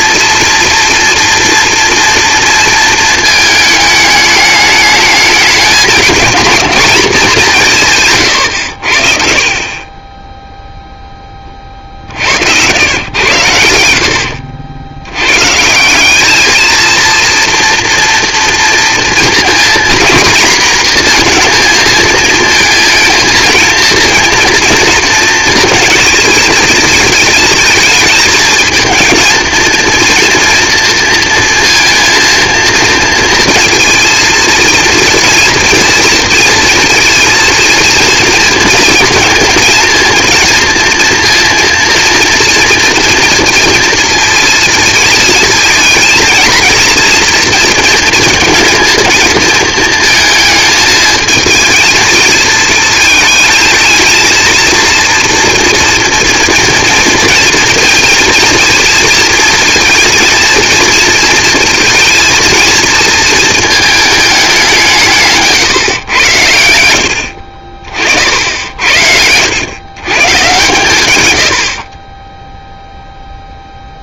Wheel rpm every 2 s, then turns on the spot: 240, 230, 210, 230, 90, 0, 100, 80, 220, 230, 230, 230, 230, 220, 220, 230, 230, 230, 230, 230, 230, 230, 230, 230, 230, 220, 230, 230, 230, 240, 230, 230, 180, 80, 70, 120, 0.
8-10